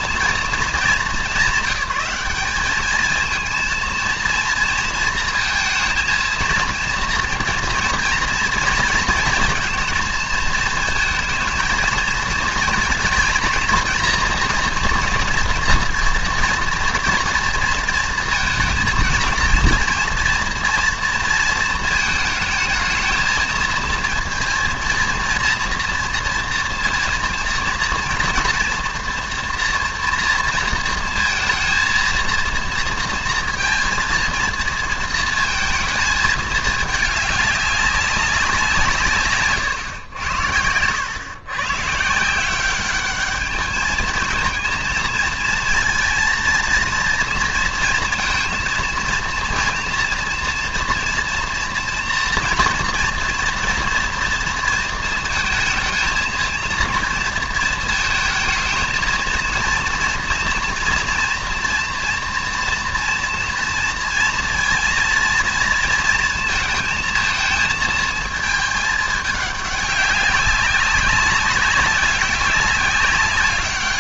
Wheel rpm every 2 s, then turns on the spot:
230, 200, 230, 230, 230, 220, 230, 240, 230, 230, 230, 220, 230, 230, 230, 230, 230, 230, 220, 180, 100, 180, 230, 230, 230, 230, 230, 230, 230, 220, 230, 230, 230, 220, 220, 200, 200.
none